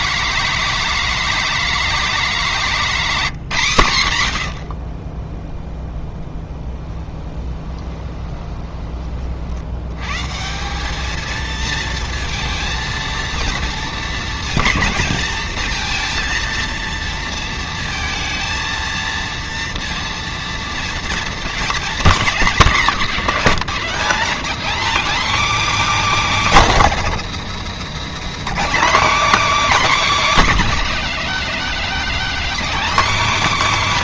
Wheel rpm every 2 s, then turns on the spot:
230, 210, 80, 20, 20, 180, 230, 220, 230, 230, 230, 220, 240, 270, 250, 270, 280.
6-10